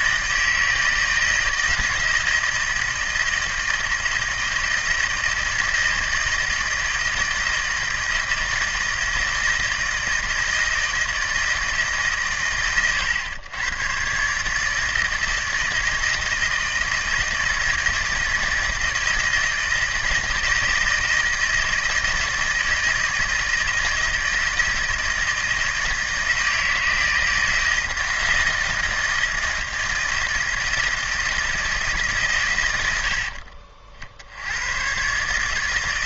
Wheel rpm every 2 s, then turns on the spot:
160, 160, 160, 160, 160, 160, 130, 150, 170, 160, 160, 160, 160, 160, 160, 160, 100, 110.
none